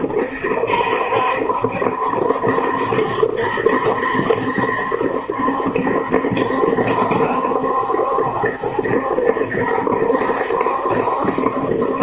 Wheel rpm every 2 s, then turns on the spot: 70, 70, 70, 70, 70, 70.
none